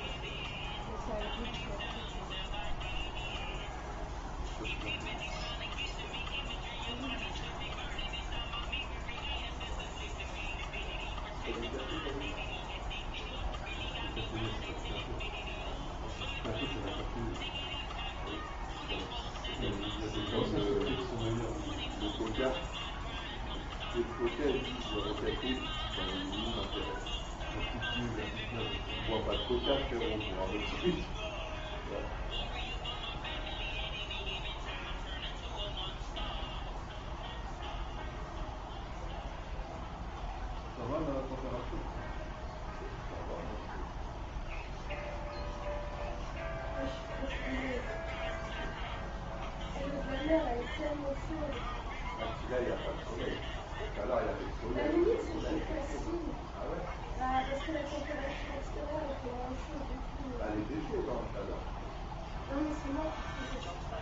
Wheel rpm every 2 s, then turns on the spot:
0, 0, 0, 0, 0, 0, 0, 0, 0, 0, 0, 0, 0, 0, 0, 0, 0, 0, 0, 0, 0, 0, 0, 0, 0, 0, 0, 0, 0, 0, 0, 0.
none